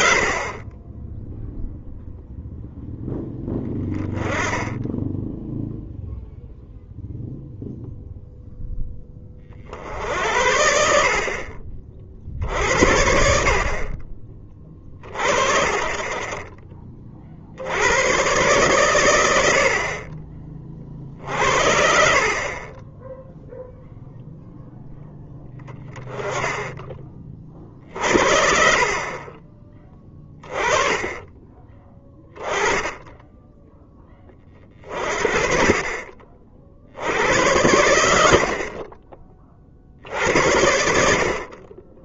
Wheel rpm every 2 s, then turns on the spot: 30, 0, 10, 0, 10, 60, 70, 30, 30, 110, 40, 20, 0, 10, 40, 20, 10, 40, 60, 40, 70.
none